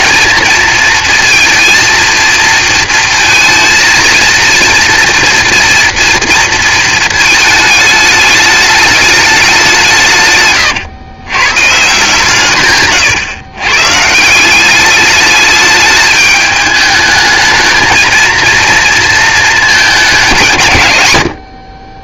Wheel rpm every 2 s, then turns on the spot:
230, 230, 230, 230, 210, 120, 140, 190, 210, 230, 130.
none